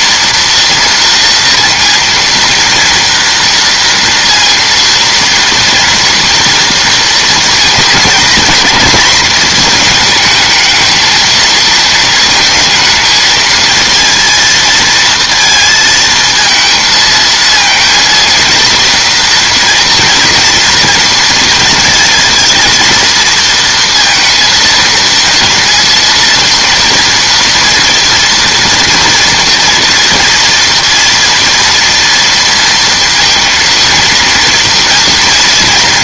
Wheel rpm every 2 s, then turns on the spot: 230, 230, 230, 230, 230, 220, 230, 230, 230, 230, 230, 230, 230, 230, 240, 230, 230, 230.
none